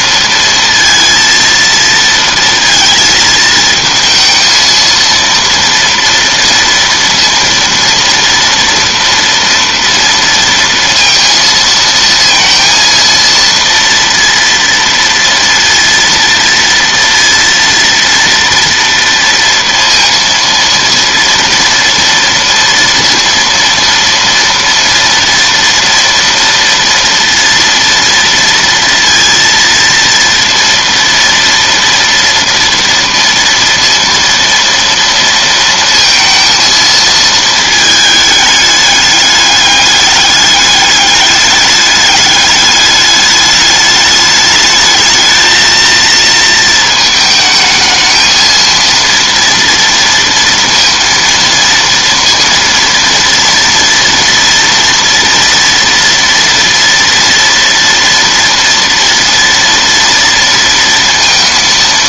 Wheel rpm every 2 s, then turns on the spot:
230, 230, 230, 230, 230, 230, 230, 230, 230, 230, 230, 230, 230, 230, 230, 230, 230, 230, 230, 210, 210, 210, 210, 230, 230, 230, 230, 230, 230, 230, 230.
none